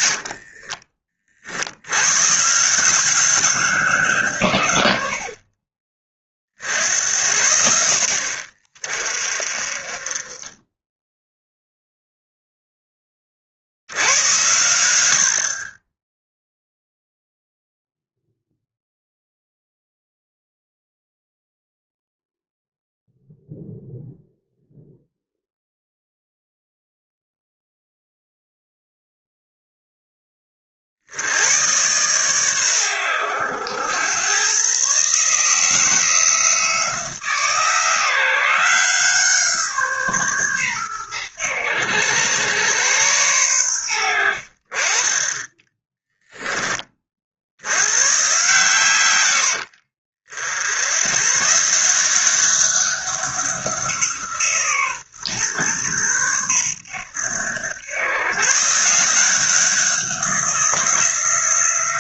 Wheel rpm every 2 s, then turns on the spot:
50, 160, 110, 60, 50, 20, 0, 90, 0, 0, 0, 0, 0, 0, 0, 30, 110, 120, 170, 170, 120, 110, 50, 20, 130, 80, 190, 150, 110, 140, 180.
0-2